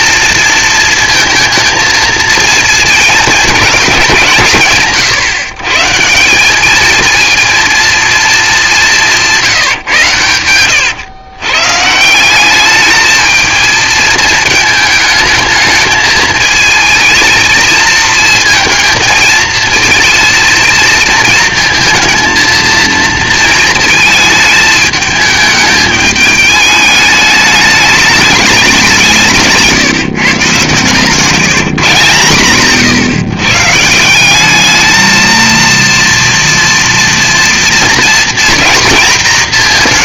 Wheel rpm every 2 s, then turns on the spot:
230, 220, 150, 220, 180, 110, 210, 220, 220, 230, 230, 230, 220, 210, 190, 130, 140, 220, 230, 230.
30-32